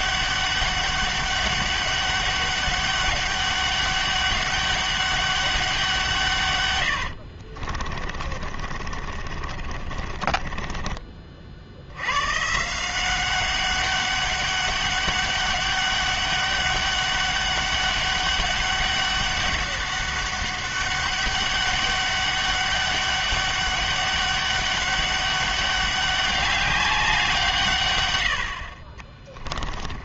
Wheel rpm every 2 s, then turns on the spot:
200, 200, 200, 110, 40, 30, 170, 200, 200, 200, 200, 200, 200, 190, 60.
8-12